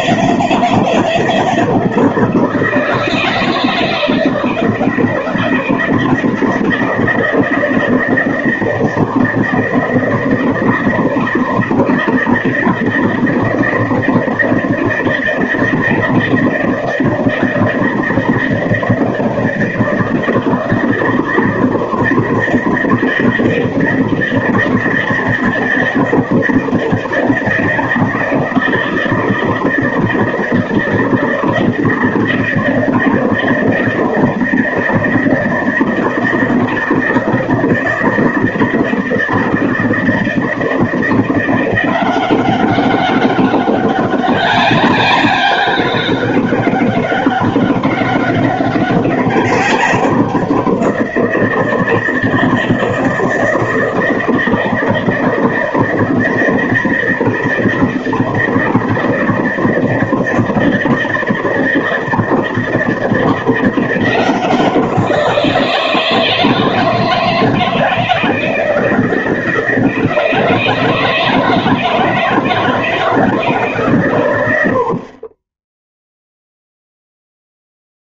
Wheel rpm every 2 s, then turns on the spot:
160, 160, 160, 160, 160, 160, 160, 160, 160, 160, 150, 160, 160, 160, 160, 160, 160, 160, 160, 160, 160, 170, 190, 200, 200, 190, 160, 160, 160, 160, 160, 160, 170, 160, 160, 160, 160, 110, 0.
none